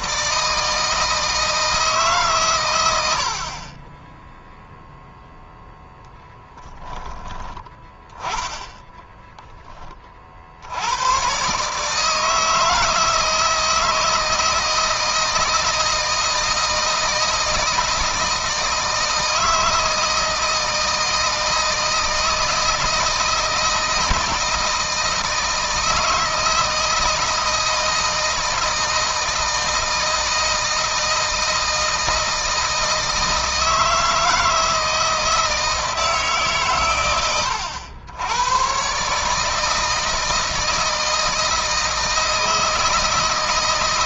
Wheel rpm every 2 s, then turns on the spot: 150, 120, 0, 10, 10, 80, 160, 160, 160, 160, 160, 160, 160, 160, 160, 160, 160, 160, 130, 110, 160, 160.
none